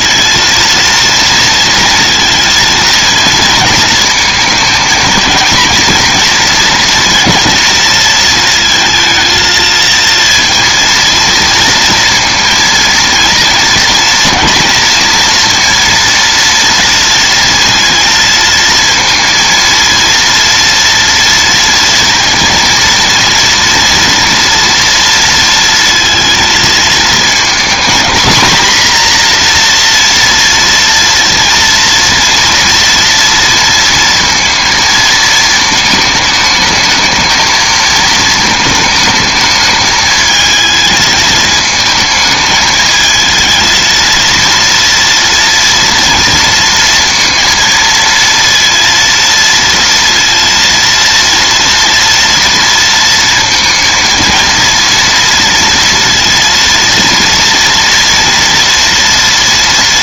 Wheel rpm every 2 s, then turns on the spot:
230, 230, 230, 230, 220, 230, 230, 230, 230, 230, 230, 230, 230, 230, 250, 240, 230, 220, 220, 220, 220, 220, 230, 230, 230, 230, 230, 230, 230, 230.
none